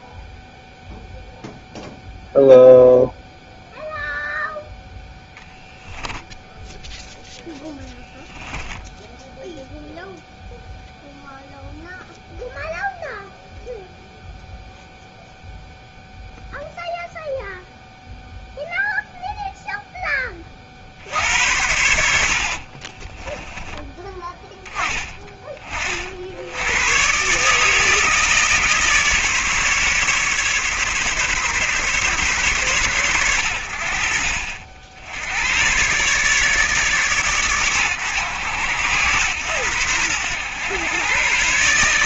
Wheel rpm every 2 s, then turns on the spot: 0, 0, 0, 0, 0, 0, 0, 0, 0, 0, 60, 30, 10, 110, 150, 140, 120, 70, 140, 110, 120.
22-24